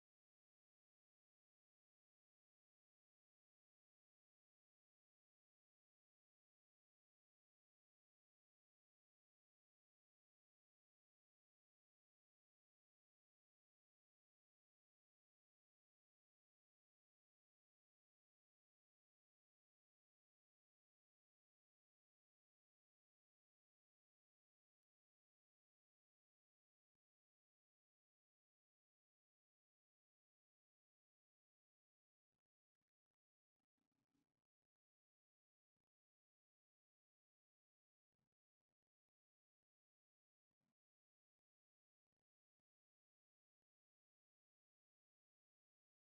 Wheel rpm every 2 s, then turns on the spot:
0, 0, 0, 0, 0, 0, 0, 0, 0, 0, 0, 0, 0, 0, 0, 0, 0, 0, 0, 0, 0, 0, 0.
none